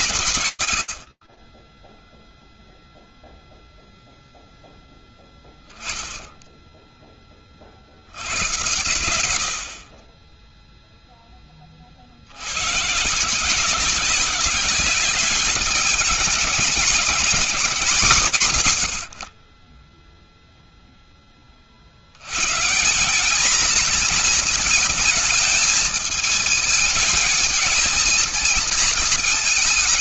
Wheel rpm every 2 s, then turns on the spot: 90, 0, 0, 30, 60, 20, 170, 200, 190, 30, 60, 220, 220, 220, 230.
none